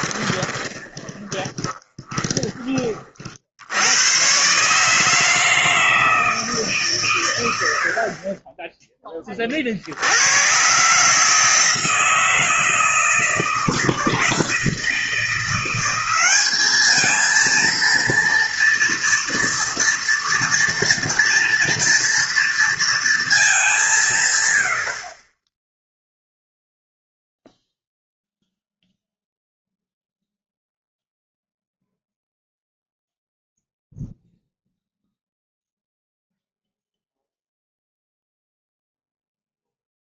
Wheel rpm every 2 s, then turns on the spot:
20, 20, 130, 150, 20, 120, 160, 160, 200, 230, 230, 230, 100, 0, 0, 0, 0, 0, 0, 0.
0-2